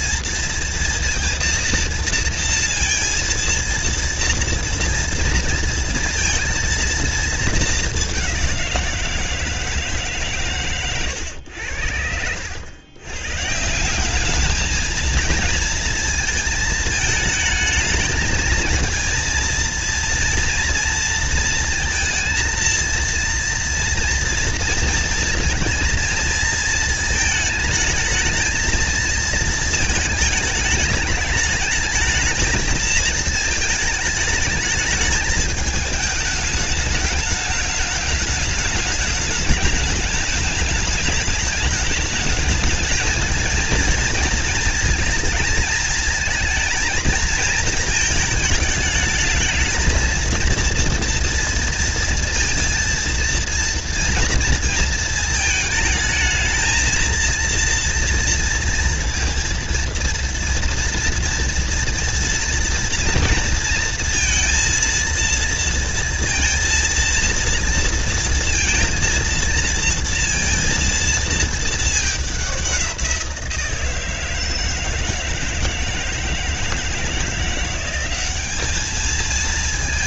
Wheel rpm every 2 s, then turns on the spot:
230, 230, 230, 230, 170, 120, 120, 220, 220, 230, 230, 230, 230, 220, 220, 210, 220, 220, 210, 210, 210, 220, 220, 220, 220, 230, 230, 220, 230, 230, 230, 230, 230, 230, 230, 230, 180, 160, 160, 220.
none